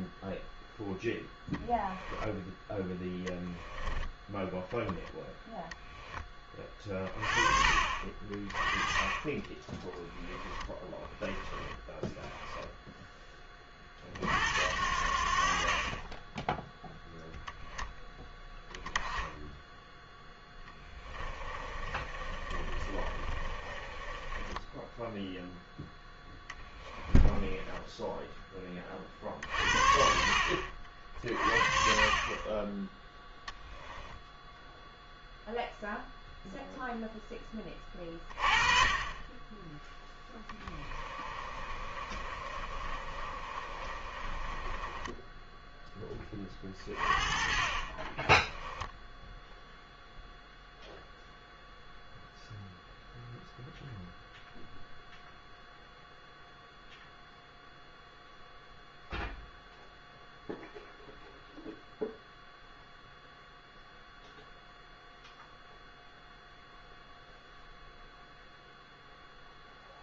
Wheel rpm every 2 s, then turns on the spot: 0, 10, 10, 30, 20, 10, 10, 80, 0, 10, 20, 30, 10, 10, 20, 50, 10, 0, 0, 30, 20, 30, 20, 30, 10, 0, 0, 0, 0, 0, 0, 0, 0, 0, 0.
10-12 20-28 40-46 48-50